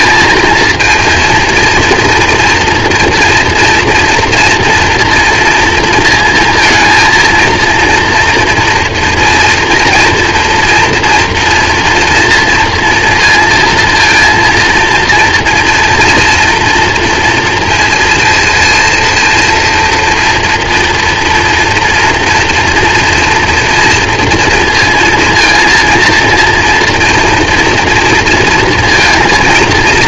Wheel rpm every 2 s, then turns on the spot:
230, 230, 230, 230, 230, 230, 230, 230, 240, 230, 240, 230, 230, 230, 230.
none